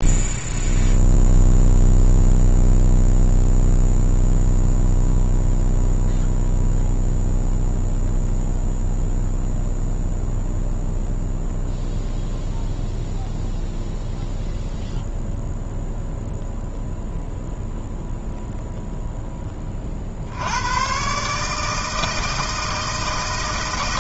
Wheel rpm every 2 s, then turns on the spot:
0, 0, 0, 0, 0, 0, 0, 0, 0, 0, 100, 160.
none